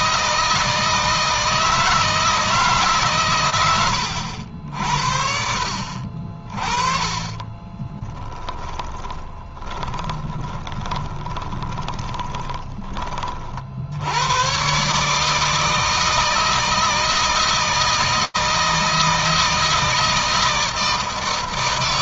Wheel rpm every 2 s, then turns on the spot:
160, 130, 60, 30, 20, 20, 30, 150, 160, 160, 160.
6-12